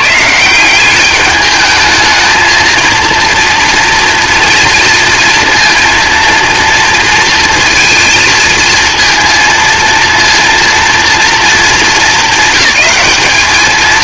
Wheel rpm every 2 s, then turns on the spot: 190, 230, 230, 230, 230, 230, 200.
none